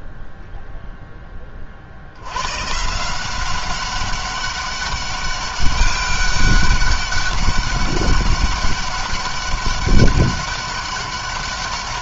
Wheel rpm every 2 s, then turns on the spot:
0, 110, 200, 200, 200, 200.
none